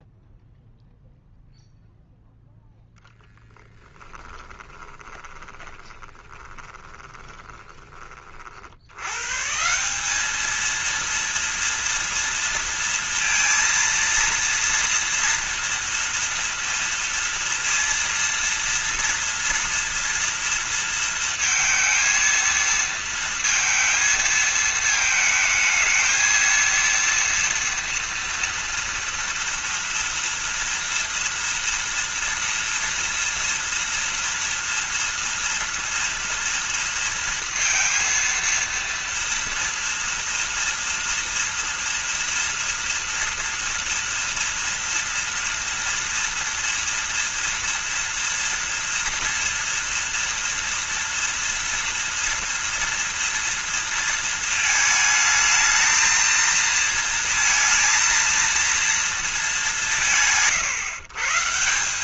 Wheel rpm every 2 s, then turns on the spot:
0, 0, 20, 20, 70, 220, 230, 230, 230, 230, 230, 230, 220, 230, 230, 230, 240, 230, 230, 230, 230, 230, 230, 230, 230, 230, 230, 220, 230, 230, 130.
4-8